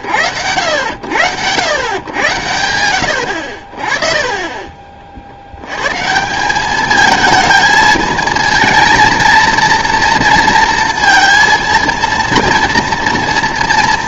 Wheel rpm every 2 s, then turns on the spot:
90, 90, 30, 200, 220, 230, 230.
none